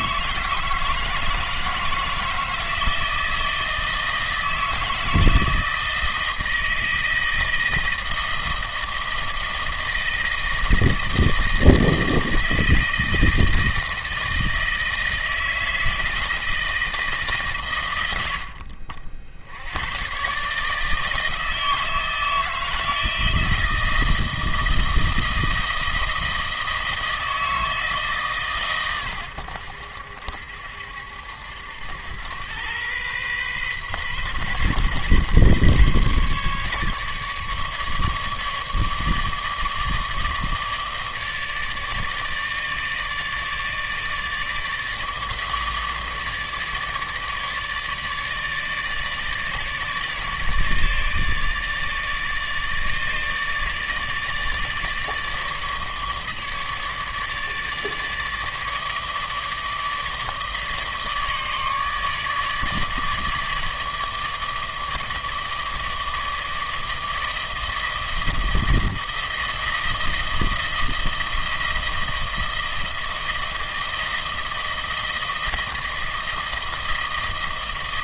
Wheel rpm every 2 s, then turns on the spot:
160, 160, 160, 160, 160, 160, 160, 160, 160, 50, 150, 160, 160, 160, 130, 70, 110, 130, 150, 150, 150, 150, 150, 150, 150, 150, 150, 150, 150, 150, 150, 150, 150, 160, 160, 160, 160, 160, 160.
none